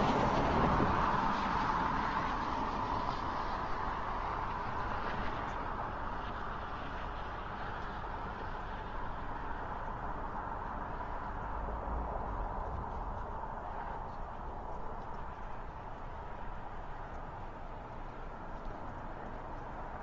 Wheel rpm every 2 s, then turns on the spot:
0, 0, 0, 0, 0, 0, 0, 0, 0, 0.
none